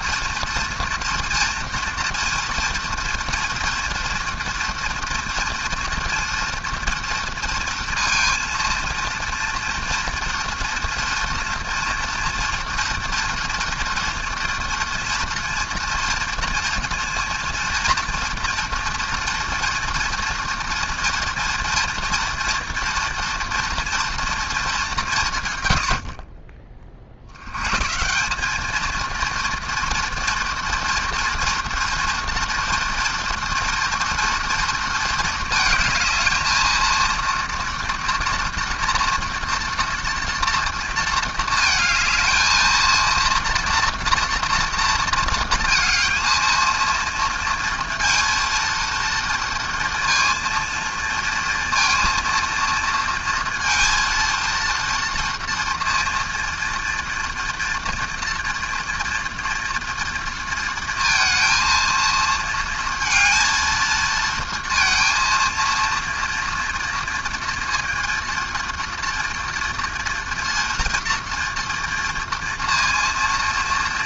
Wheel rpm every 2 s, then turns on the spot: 230, 230, 230, 230, 230, 230, 230, 230, 230, 230, 230, 230, 210, 40, 220, 230, 240, 230, 230, 230, 230, 220, 230, 230, 230, 230, 230, 230, 230, 230, 230, 230, 230, 230, 230, 240, 230.
none